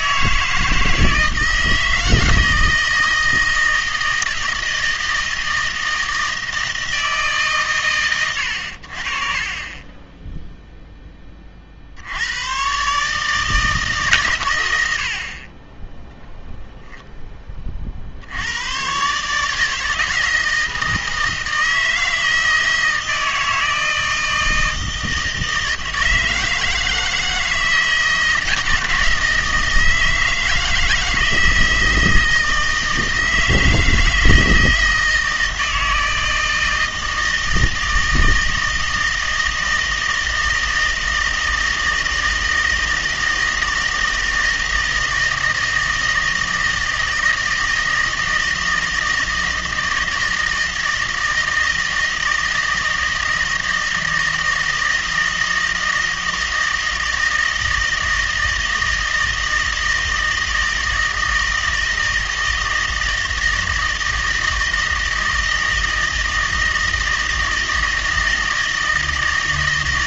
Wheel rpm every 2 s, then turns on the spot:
160, 160, 160, 160, 70, 0, 130, 100, 0, 100, 160, 160, 160, 160, 170, 160, 160, 160, 160, 160, 160, 160, 160, 160, 160, 160, 160, 160, 160, 160, 160, 160, 160, 160, 160.
none